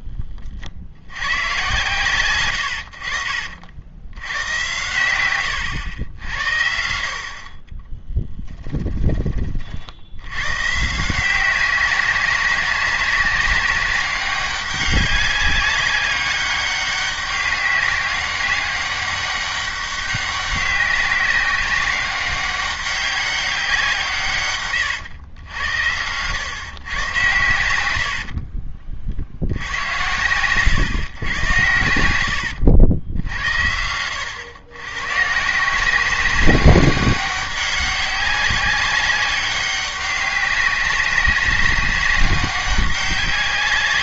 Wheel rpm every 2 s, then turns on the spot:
50, 90, 110, 60, 20, 130, 190, 200, 200, 190, 190, 190, 130, 120, 50, 120, 90, 110, 190, 190, 200, 200.
8-10 24-26 28-30